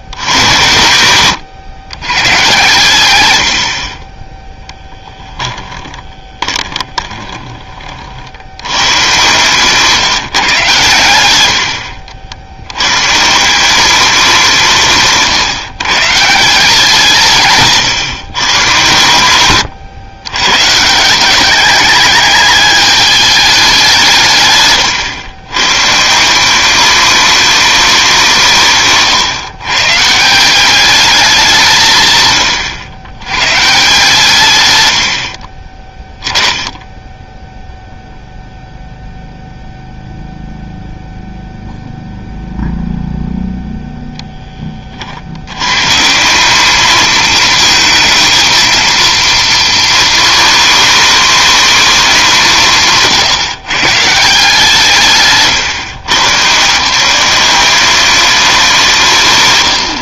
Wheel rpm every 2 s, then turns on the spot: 100, 120, 10, 20, 100, 120, 100, 160, 170, 110, 140, 210, 130, 200, 150, 200, 110, 110, 10, 0, 0, 0, 30, 210, 230, 230, 160, 170, 170, 180.
4-8 24-26 28-30 58-60